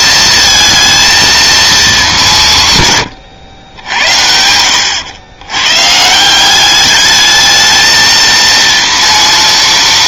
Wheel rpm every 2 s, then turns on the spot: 220, 150, 90, 200, 230.
4-6